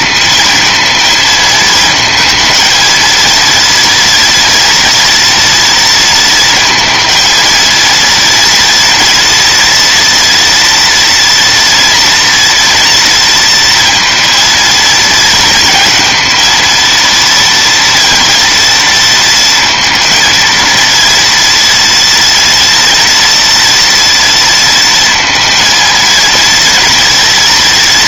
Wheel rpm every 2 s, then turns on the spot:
220, 220, 230, 230, 230, 240, 230, 220, 230, 230, 230, 230, 230, 240.
none